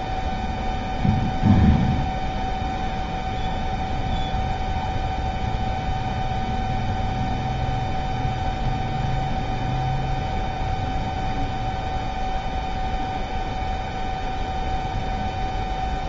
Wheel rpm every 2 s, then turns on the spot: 0, 0, 0, 0, 0, 0, 0, 0.
none